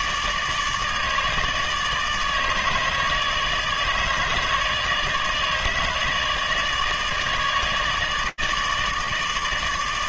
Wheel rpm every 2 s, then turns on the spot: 150, 160, 150, 150, 150.
none